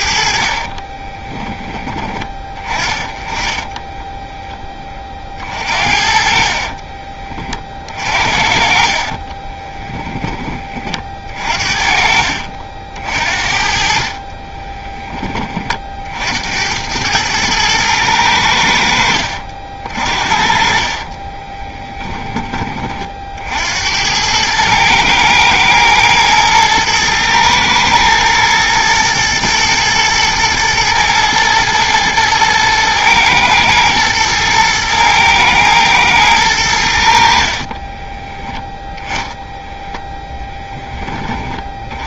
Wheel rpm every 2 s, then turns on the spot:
40, 20, 20, 40, 40, 30, 60, 10, 90, 80, 50, 30, 110, 110, 110, 120, 110, 110, 90, 10, 10.
0-2 6-10 14-16 20-22